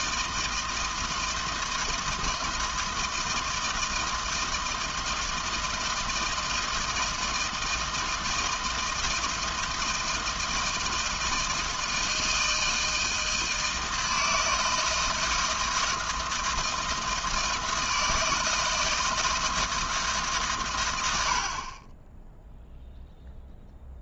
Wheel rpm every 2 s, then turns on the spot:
160, 160, 160, 160, 160, 160, 160, 160, 160, 160, 100, 0.
none